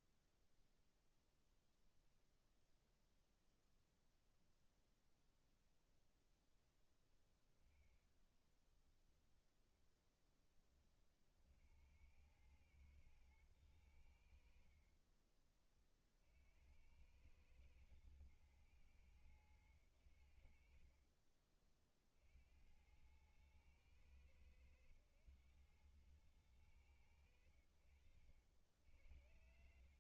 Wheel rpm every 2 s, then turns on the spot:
0, 0, 0, 20, 10, 60, 110, 30, 100, 100, 30, 100, 100, 70, 90.
6-8 20-22